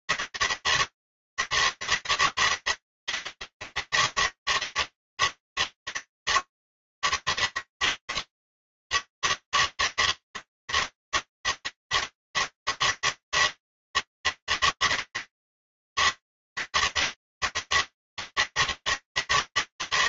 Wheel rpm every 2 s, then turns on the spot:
160, 160, 160, 160, 150, 160, 160, 160, 160, 160.
none